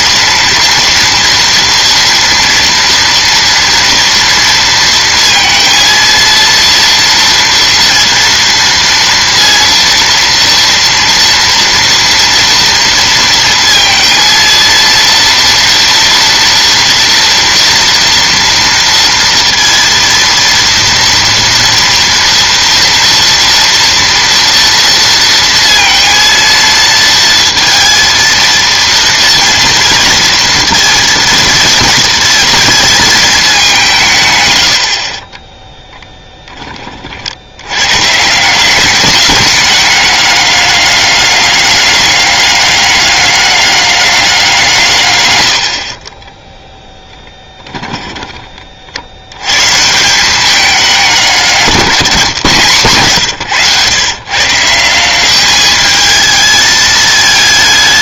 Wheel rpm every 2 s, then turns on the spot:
230, 230, 230, 230, 230, 230, 230, 230, 230, 230, 230, 230, 230, 230, 230, 230, 230, 100, 20, 180, 200, 200, 160, 0, 40, 200, 140, 160, 220.
none